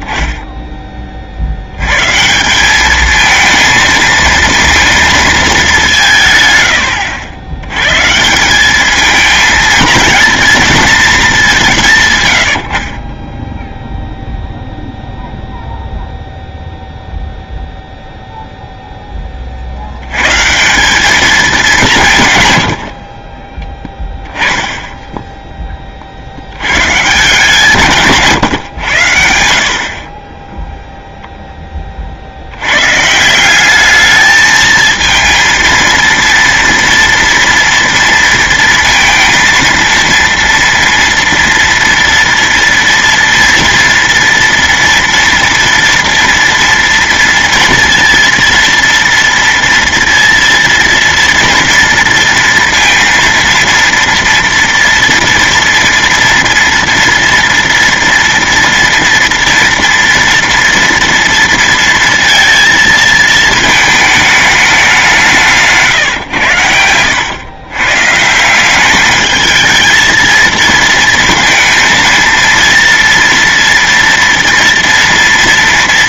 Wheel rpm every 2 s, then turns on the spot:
10, 190, 230, 100, 200, 230, 60, 0, 0, 0, 160, 90, 10, 100, 130, 10, 100, 220, 230, 230, 230, 230, 230, 230, 230, 230, 230, 230, 230, 230, 230, 230, 210, 90, 180, 230, 230, 230.
none